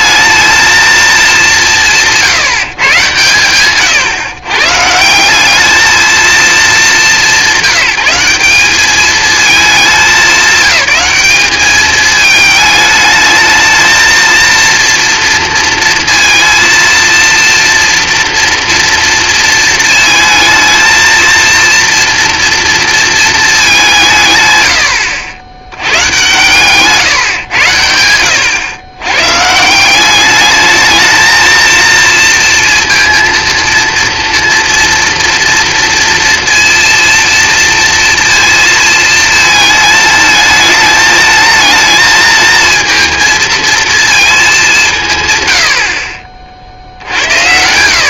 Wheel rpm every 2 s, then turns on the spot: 220, 140, 150, 200, 190, 190, 210, 230, 230, 230, 220, 230, 110, 130, 110, 210, 230, 230, 240, 230, 220, 220, 200, 60.
none